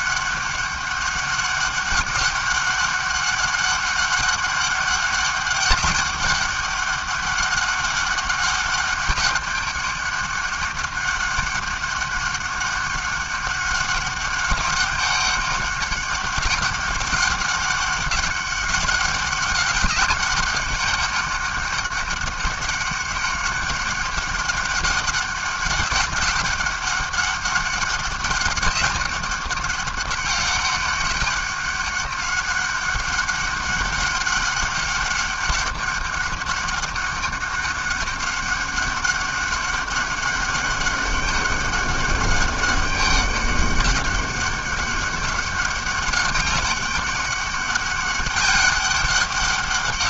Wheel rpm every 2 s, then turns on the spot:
200, 200, 200, 200, 200, 200, 200, 200, 200, 200, 190, 200, 190, 190, 200, 200, 200, 200, 200, 200, 200, 200, 200, 200, 200.
none